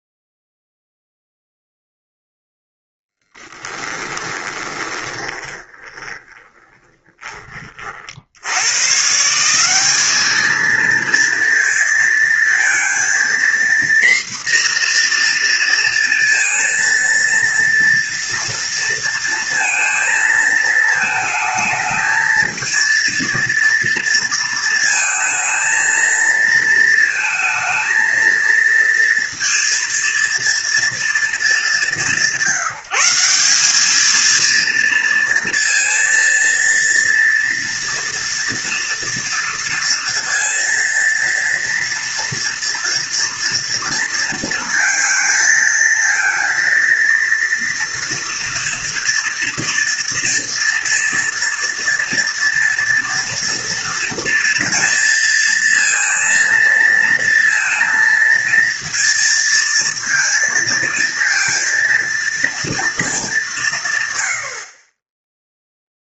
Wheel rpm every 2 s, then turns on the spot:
0, 10, 20, 20, 100, 220, 230, 240, 230, 230, 220, 230, 230, 230, 230, 230, 190, 230, 230, 230, 230, 230, 230, 230, 230, 230, 230, 230, 230, 230, 230, 230, 60.
4-8